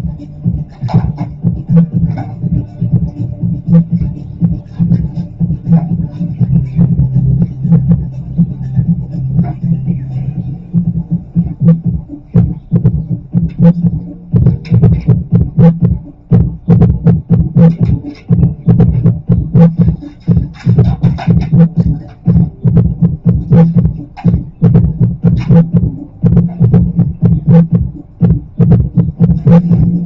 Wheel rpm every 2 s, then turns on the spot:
0, 0, 0, 0, 0, 0, 0, 0, 0, 0, 0, 0, 0, 0, 0.
none